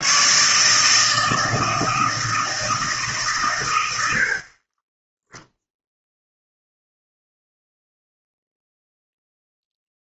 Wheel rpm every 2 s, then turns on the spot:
140, 160, 40, 0, 0.
none